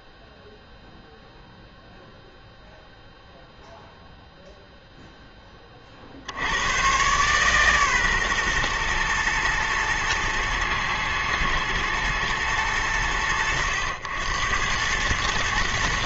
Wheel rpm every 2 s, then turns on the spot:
0, 0, 30, 140, 120, 110, 90, 120.
none